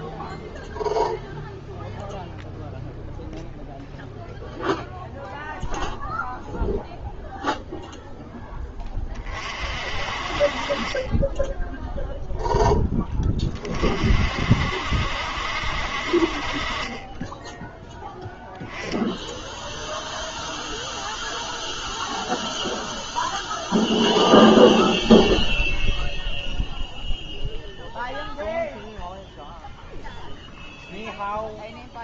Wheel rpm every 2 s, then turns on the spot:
0, 0, 0, 0, 10, 40, 0, 60, 40, 10, 0, 0, 0, 0, 0, 0.
none